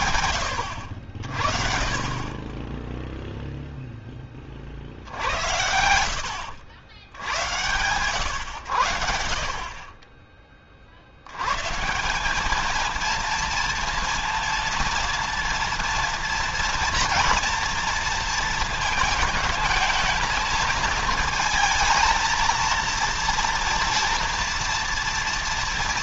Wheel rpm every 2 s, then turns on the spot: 70, 20, 30, 80, 100, 40, 210, 230, 230, 220, 220, 230, 230.
none